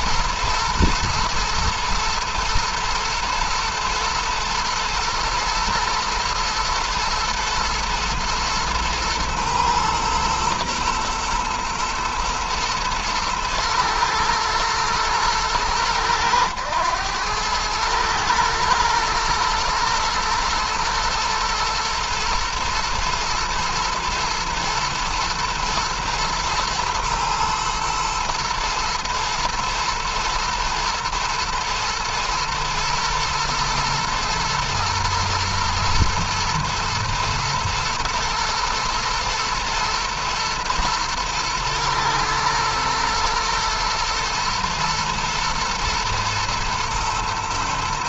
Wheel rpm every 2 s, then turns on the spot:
110, 120, 110, 120, 120, 120, 110, 110, 100, 110, 120, 120, 120, 110, 110, 120, 120, 120, 120, 120, 110, 110, 110, 120.
none